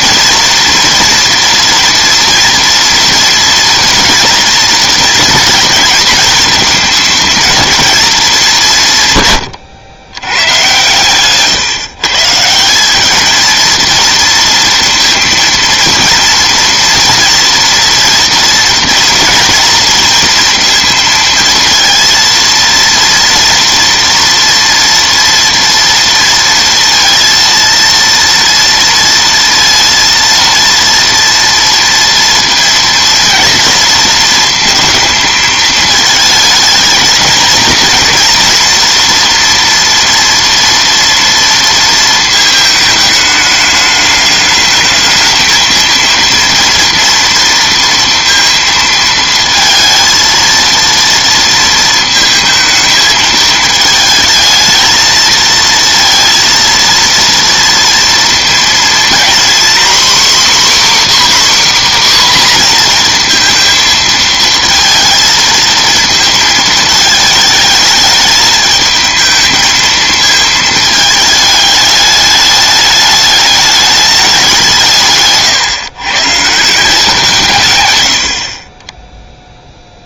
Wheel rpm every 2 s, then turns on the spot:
230, 230, 230, 220, 170, 130, 190, 230, 230, 230, 230, 230, 230, 230, 230, 230, 230, 230, 230, 240, 230, 220, 210, 230, 230, 230, 220, 220, 230, 230, 280, 250, 220, 220, 210, 220, 210, 180, 160, 30.
none